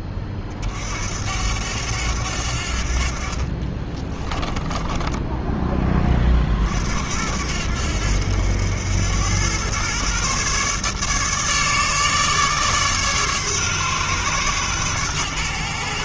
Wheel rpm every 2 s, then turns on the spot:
60, 60, 20, 60, 90, 140, 150, 120.
4-6